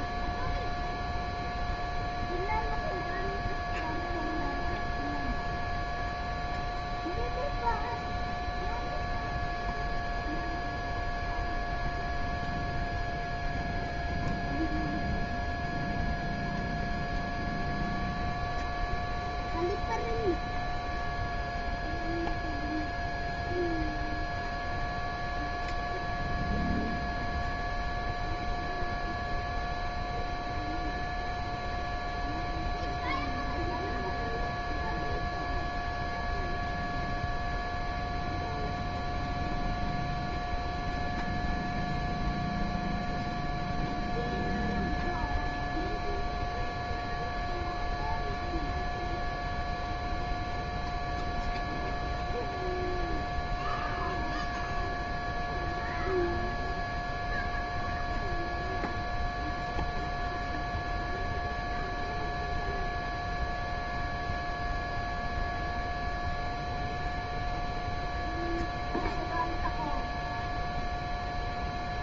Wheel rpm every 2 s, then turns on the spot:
0, 0, 0, 0, 0, 0, 0, 0, 0, 0, 0, 0, 0, 0, 0, 0, 0, 0, 0, 0, 0, 0, 0, 0, 0, 0, 0, 0, 0, 0, 0, 0, 0, 0, 0, 0.
none